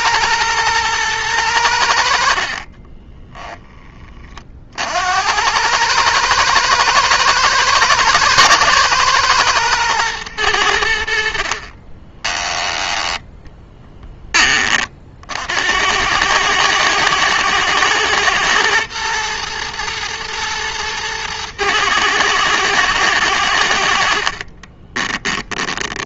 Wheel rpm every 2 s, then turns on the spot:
110, 30, 60, 110, 110, 70, 10, 40, 110, 120, 110, 110, 20.
2-4 24-26